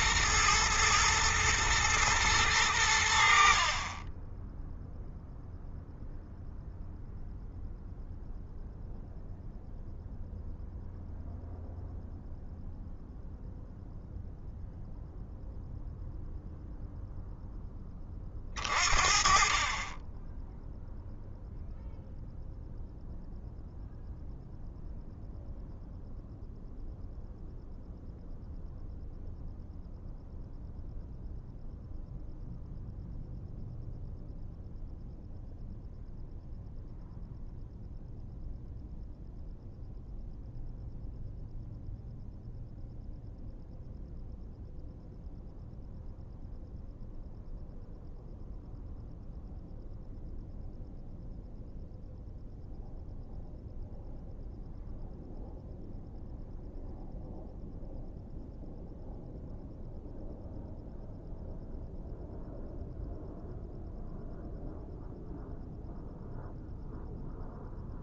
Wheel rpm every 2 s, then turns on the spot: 110, 100, 10, 0, 0, 0, 0, 0, 0, 40, 10, 0, 0, 0, 0, 0, 0, 0, 0, 0, 0, 0, 0, 0, 0, 0, 0, 0, 0, 0, 0, 0, 0, 0.
none